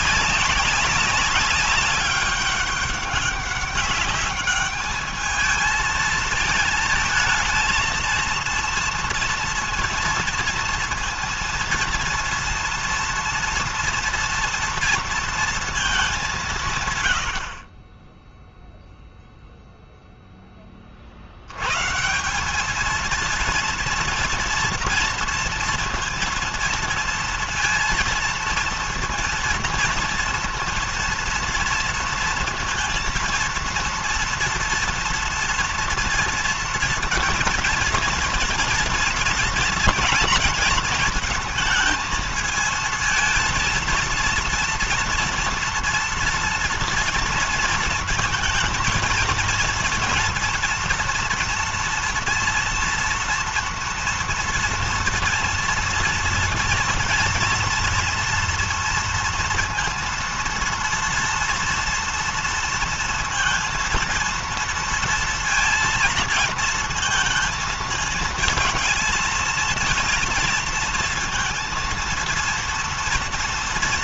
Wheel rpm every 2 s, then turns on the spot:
190, 200, 210, 220, 230, 230, 230, 230, 130, 0, 40, 210, 230, 230, 230, 230, 230, 230, 230, 230, 230, 220, 230, 230, 230, 230, 230, 230, 230, 230, 230, 230, 230, 230, 220, 230, 230.
none